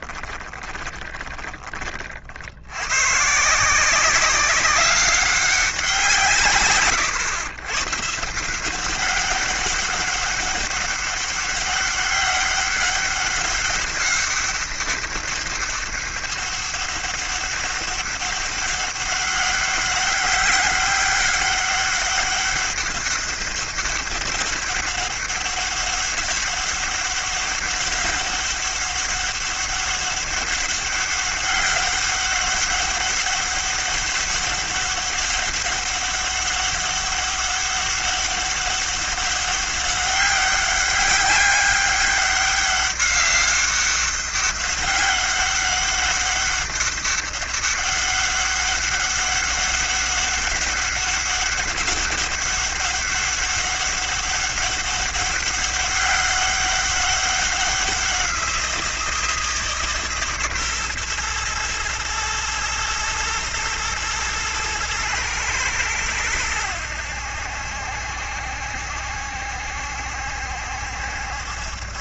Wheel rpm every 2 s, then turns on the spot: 10, 80, 190, 130, 170, 200, 200, 200, 200, 200, 200, 200, 200, 200, 200, 200, 200, 200, 200, 200, 200, 200, 200, 200, 190, 200, 200, 200, 200, 180, 130, 110, 110, 90, 70, 70.
0-2